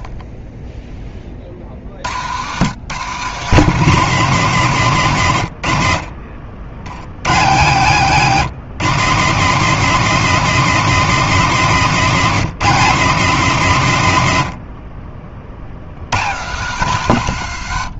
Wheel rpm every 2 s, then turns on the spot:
80, 210, 70, 150, 210, 190, 160, 60, 100.
none